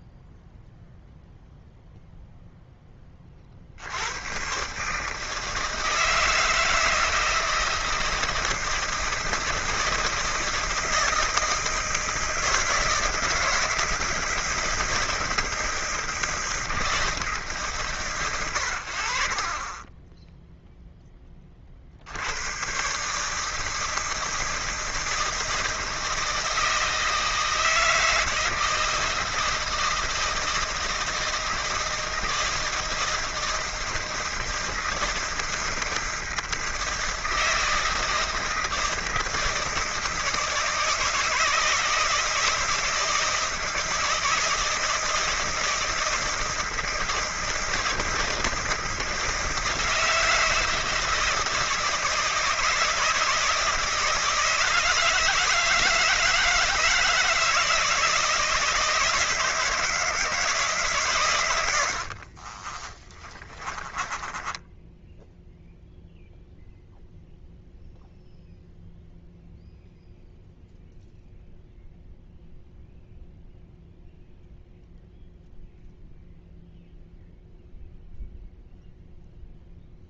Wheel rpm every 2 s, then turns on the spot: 0, 10, 130, 160, 170, 160, 160, 160, 160, 90, 0, 110, 160, 160, 160, 160, 160, 160, 160, 160, 160, 160, 160, 160, 160, 160, 160, 170, 160, 160, 160, 40, 20, 0, 0, 0, 0, 0, 0, 0.
62-66